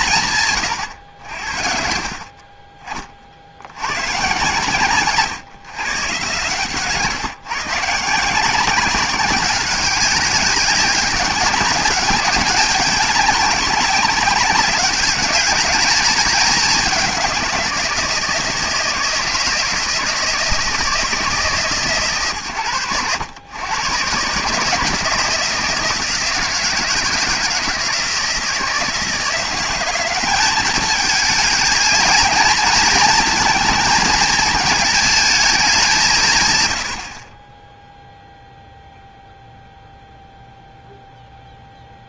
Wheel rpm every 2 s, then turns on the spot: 130, 40, 130, 140, 180, 190, 200, 200, 190, 160, 160, 120, 150, 160, 160, 200, 230, 220, 120, 0, 0.
none